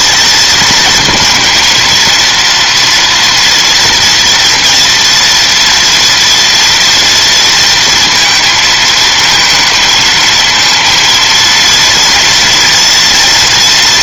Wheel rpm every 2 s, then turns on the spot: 230, 230, 230, 230, 230, 220, 240.
none